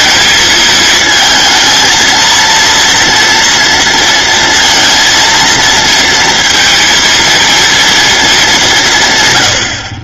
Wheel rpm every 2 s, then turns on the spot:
220, 230, 230, 230, 170.
none